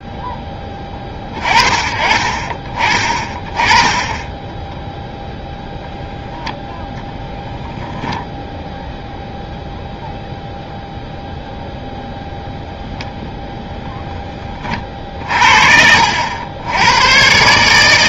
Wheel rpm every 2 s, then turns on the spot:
10, 30, 10, 0, 0, 0, 0, 30, 90.
4-6 14-16